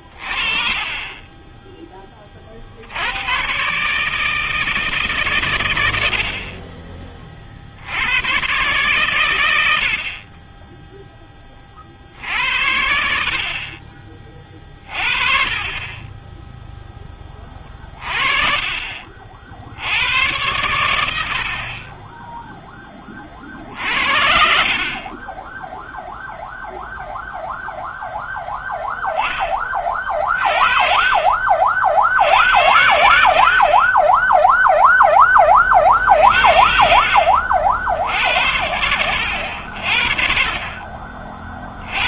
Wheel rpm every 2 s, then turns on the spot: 20, 50, 150, 20, 130, 20, 60, 30, 0, 30, 100, 0, 60, 0, 0, 20, 80, 10, 50, 70, 50.
24-26